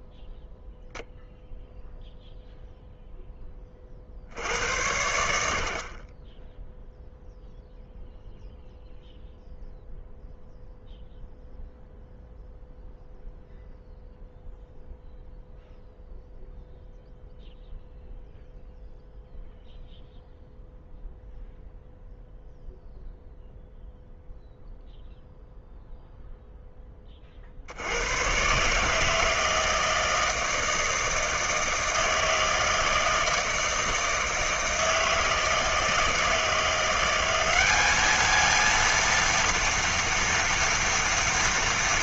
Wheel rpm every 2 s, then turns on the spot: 0, 0, 70, 0, 0, 0, 0, 0, 0, 0, 0, 0, 0, 10, 140, 160, 160, 160, 170, 230, 230.
none